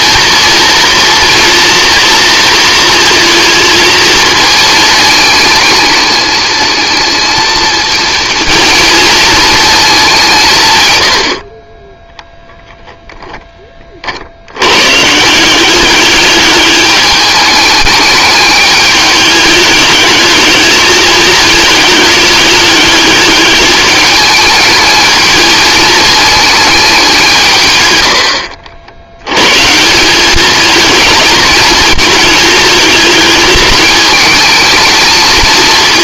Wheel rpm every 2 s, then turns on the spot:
230, 230, 220, 220, 230, 120, 0, 130, 210, 210, 210, 210, 220, 200, 80, 220, 220, 220.
none